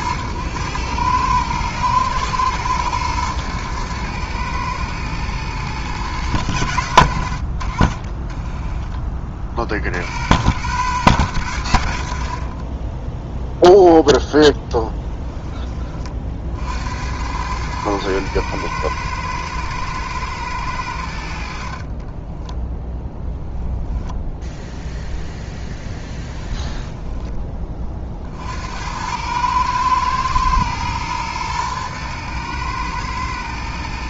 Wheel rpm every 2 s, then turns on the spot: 110, 110, 110, 90, 30, 120, 10, 10, 80, 110, 70, 0, 0, 10, 90, 120, 110.
26-28